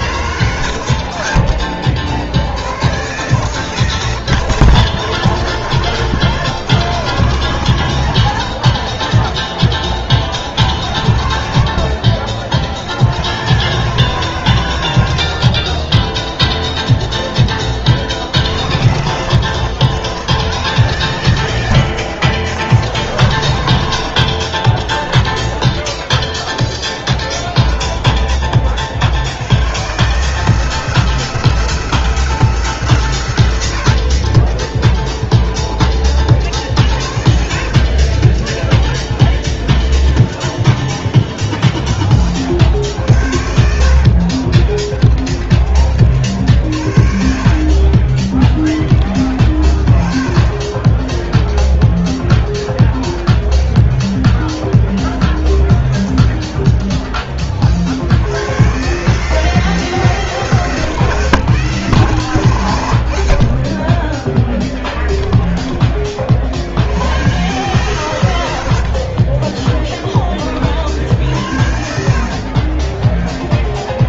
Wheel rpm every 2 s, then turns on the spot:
110, 90, 140, 150, 110, 120, 80, 130, 60, 100, 150, 120, 20, 0, 20, 160, 150, 30, 60, 10, 0, 70, 30, 50, 20, 10, 0, 0, 0, 120, 150, 110, 20, 70, 80, 40, 40.
24-26 34-36 38-40 44-46 64-66 68-70 72-74